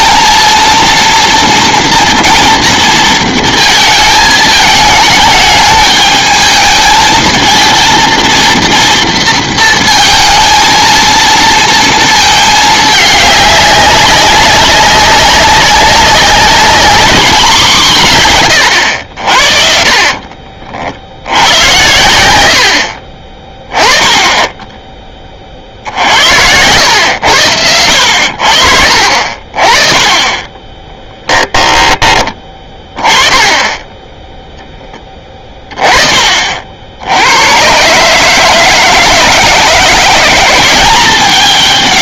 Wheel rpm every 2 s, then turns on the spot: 230, 230, 220, 220, 230, 230, 210, 200, 210, 110, 50, 70, 20, 110, 50, 20, 20, 10, 60, 160, 190.
24-26